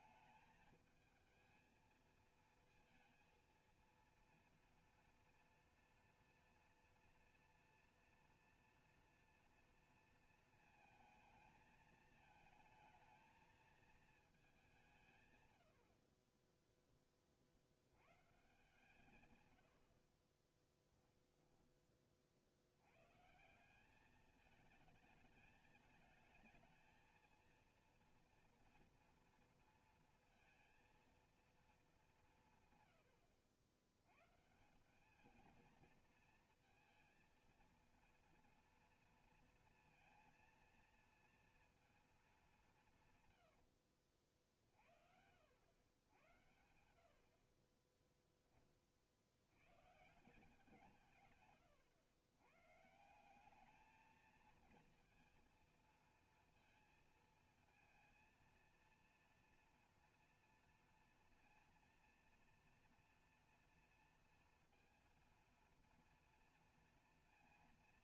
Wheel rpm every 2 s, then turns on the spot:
220, 230, 230, 230, 240, 220, 220, 170, 20, 150, 10, 100, 220, 230, 230, 230, 140, 160, 230, 230, 230, 190, 50, 90, 10, 170, 110, 220, 230, 230, 230, 230, 230, 230.
20-22